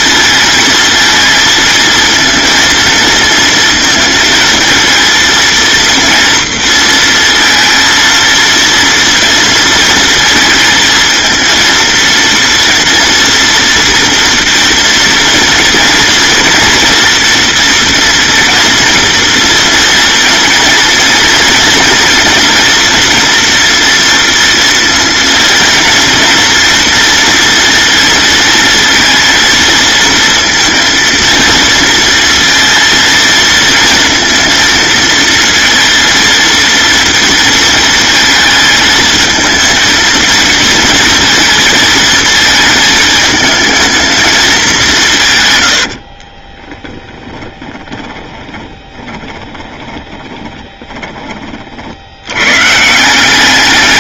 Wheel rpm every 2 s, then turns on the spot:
230, 230, 220, 230, 230, 230, 230, 230, 230, 230, 230, 230, 230, 230, 230, 230, 230, 230, 230, 220, 230, 220, 190, 10, 10, 20, 150.
46-52